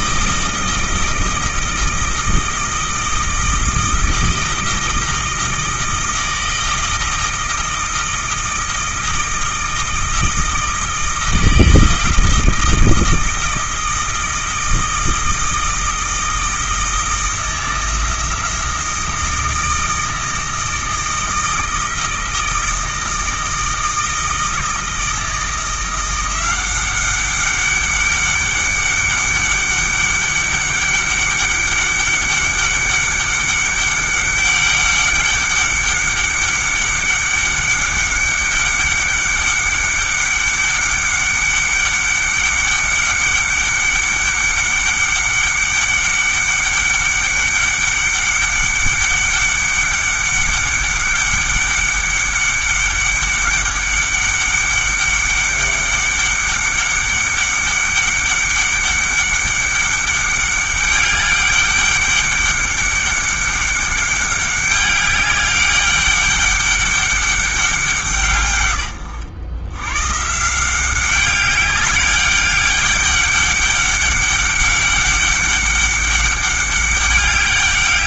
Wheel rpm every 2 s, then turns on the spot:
160, 160, 160, 160, 160, 160, 160, 160, 160, 170, 160, 160, 160, 190, 200, 200, 200, 200, 200, 200, 200, 200, 200, 200, 200, 200, 200, 200, 200, 200, 200, 200, 200, 200, 120, 180, 200, 200, 200.
none